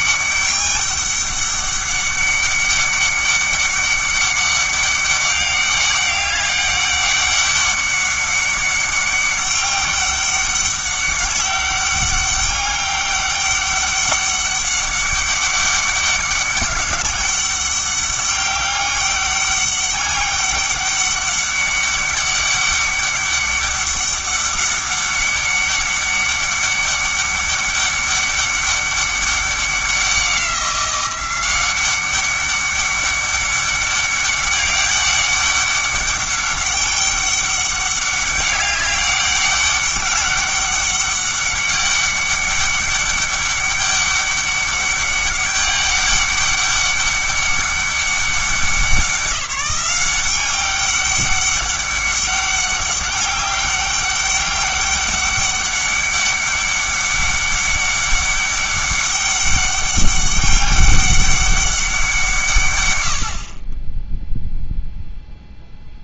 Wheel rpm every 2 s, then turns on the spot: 200, 200, 200, 200, 200, 200, 200, 200, 200, 200, 200, 200, 200, 200, 200, 180, 200, 200, 200, 200, 200, 200, 200, 200, 190, 200, 200, 200, 200, 200, 200, 130, 0.
none